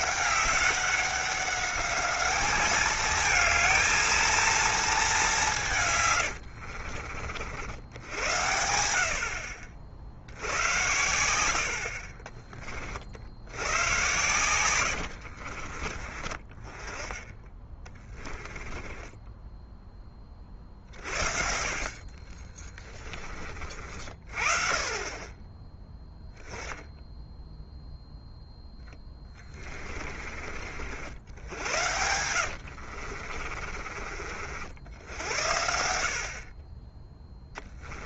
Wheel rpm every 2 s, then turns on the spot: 200, 220, 230, 70, 70, 100, 40, 100, 20, 20, 50, 20, 20, 0, 10, 60, 60, 60, 30.
6-8 14-16 18-20 22-24 28-30 32-34